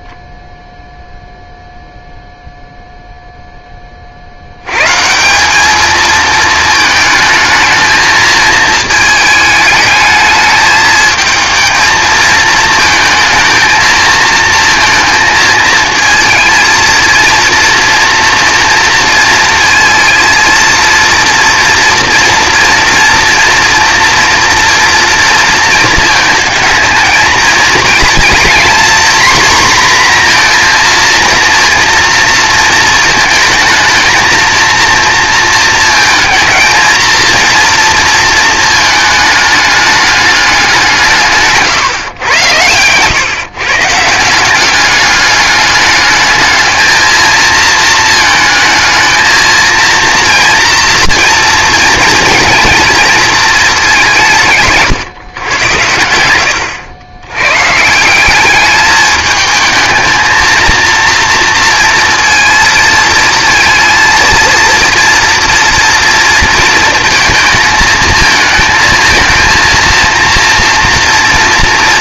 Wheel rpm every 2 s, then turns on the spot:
0, 0, 90, 220, 220, 220, 230, 230, 230, 230, 230, 240, 240, 220, 240, 240, 220, 230, 220, 220, 200, 110, 190, 220, 220, 240, 220, 150, 90, 200, 230, 230, 230, 230, 220, 240.
42-44